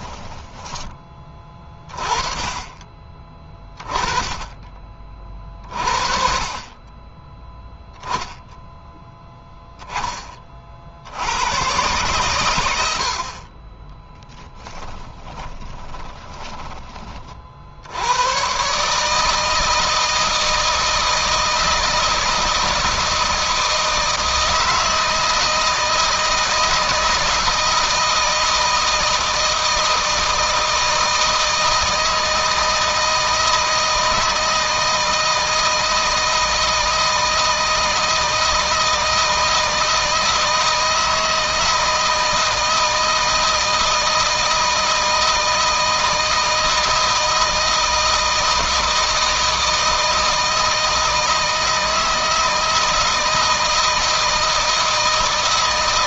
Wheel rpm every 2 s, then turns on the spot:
20, 20, 30, 20, 0, 60, 80, 10, 20, 140, 160, 160, 160, 160, 160, 160, 160, 160, 160, 160, 160, 160, 160, 160, 160, 160, 160, 160.
14-16